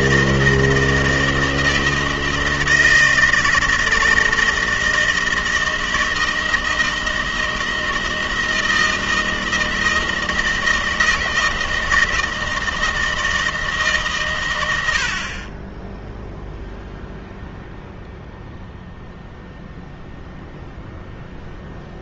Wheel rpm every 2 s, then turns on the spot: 160, 160, 160, 160, 160, 160, 160, 100, 0, 0, 0.
none